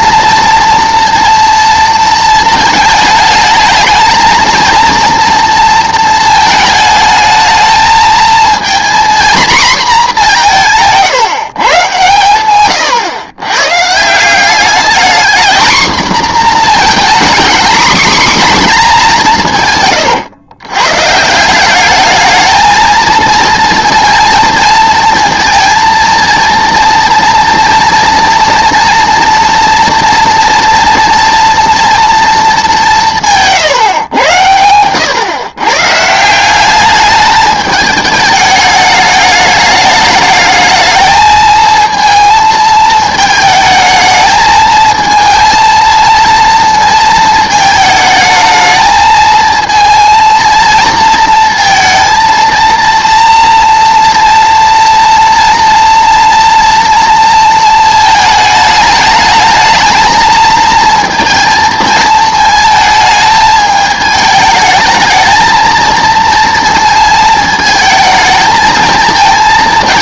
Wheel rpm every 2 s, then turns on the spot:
230, 220, 230, 220, 230, 180, 120, 200, 240, 240, 120, 220, 220, 230, 230, 230, 200, 100, 190, 210, 220, 220, 220, 230, 220, 220, 230, 230, 230, 220, 220, 220, 220, 230, 220.
none